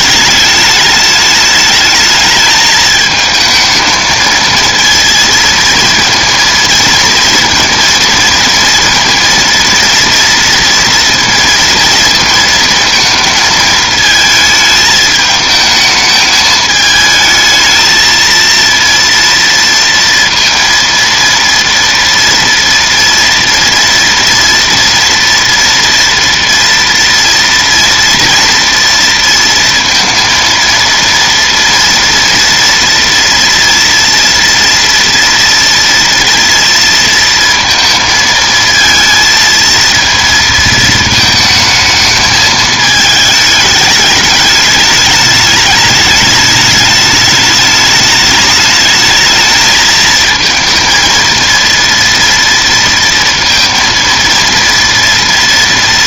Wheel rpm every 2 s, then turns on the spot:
210, 220, 230, 230, 230, 230, 230, 220, 220, 230, 230, 230, 230, 230, 230, 230, 230, 230, 230, 220, 220, 220, 210, 210, 210, 230, 230, 230.
none